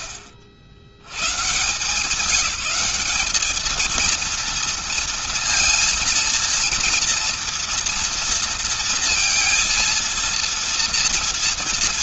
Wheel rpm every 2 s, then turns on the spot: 120, 200, 230, 230, 230, 230.
none